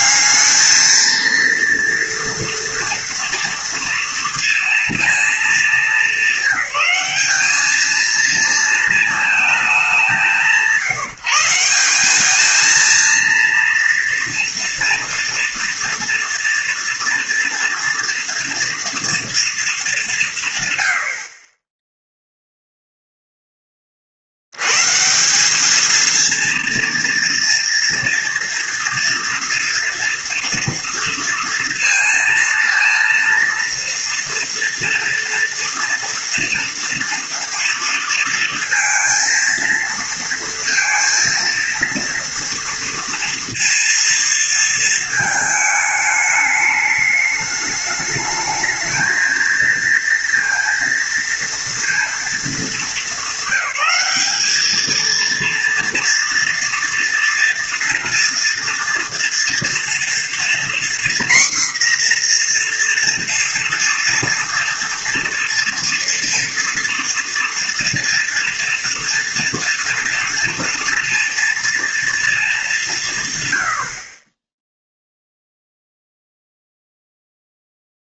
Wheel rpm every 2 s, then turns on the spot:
210, 230, 230, 200, 220, 180, 220, 230, 240, 230, 120, 0, 100, 230, 230, 230, 230, 230, 230, 230, 230, 230, 230, 210, 220, 230, 220, 220, 230, 230, 240, 240, 230, 230, 230, 230, 200, 10, 0.
none